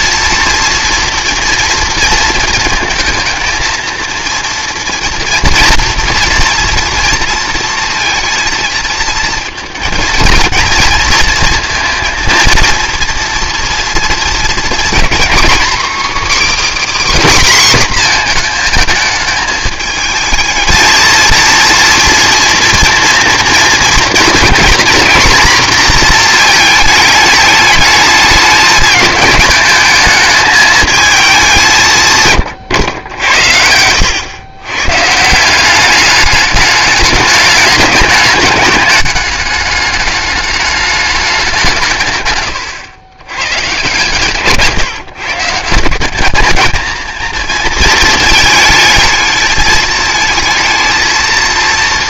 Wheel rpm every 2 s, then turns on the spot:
230, 220, 230, 230, 230, 220, 230, 240, 300, 230, 220, 240, 240, 220, 210, 220, 120, 120, 210, 200, 210, 120, 140, 220, 220, 220.
none